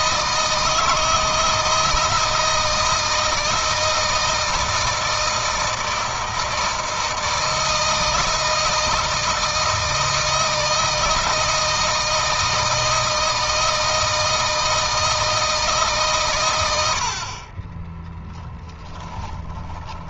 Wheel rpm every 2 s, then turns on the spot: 160, 160, 160, 160, 160, 160, 160, 160, 70, 10.
18-20